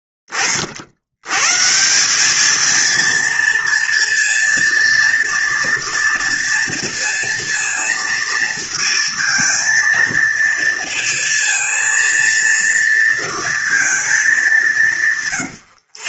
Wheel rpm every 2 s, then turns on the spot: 20, 220, 230, 230, 230, 230, 230, 200.
none